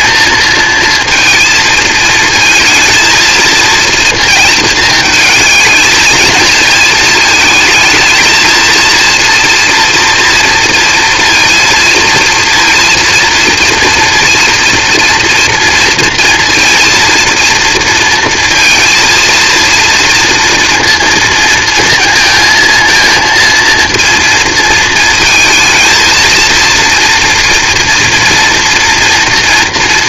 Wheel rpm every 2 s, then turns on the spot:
230, 220, 220, 220, 230, 230, 230, 230, 230, 230, 230, 220, 220, 230, 230.
none